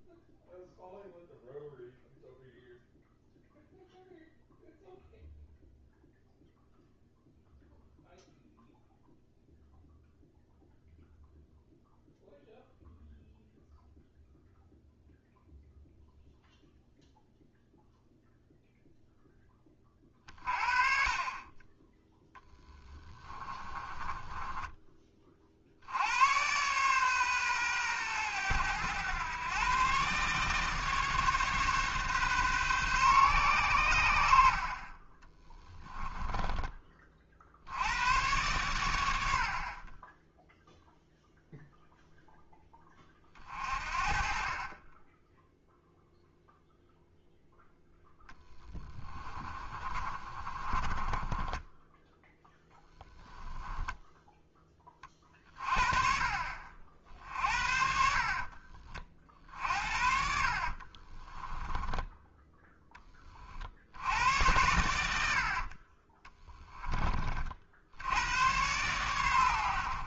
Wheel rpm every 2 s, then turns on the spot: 0, 0, 0, 0, 0, 0, 0, 0, 0, 0, 40, 10, 20, 120, 110, 150, 130, 40, 30, 100, 0, 10, 20, 0, 20, 30, 10, 20, 60, 40, 40, 10, 90, 20, 110.
22-24 34-36 48-54 60-62